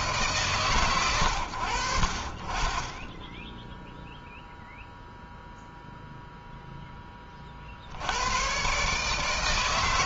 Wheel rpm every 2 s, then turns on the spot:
140, 30, 0, 0, 110.
none